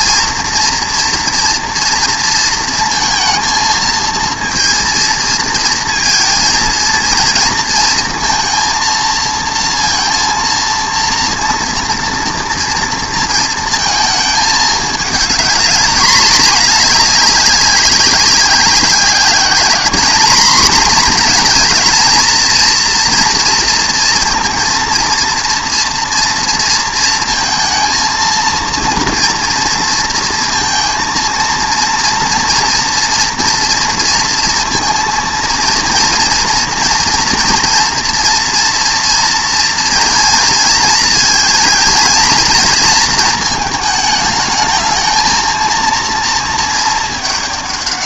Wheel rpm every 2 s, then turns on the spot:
230, 230, 230, 230, 230, 230, 230, 220, 210, 190, 230, 240, 230, 230, 230, 230, 240, 230, 240, 230, 220, 230, 220, 230.
none